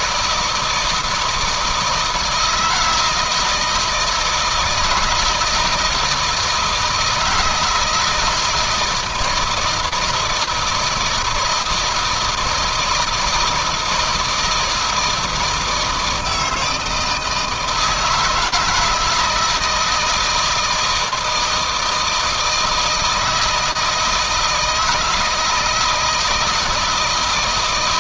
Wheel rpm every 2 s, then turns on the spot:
160, 160, 160, 160, 160, 160, 160, 160, 160, 170, 160, 160, 160, 160.
none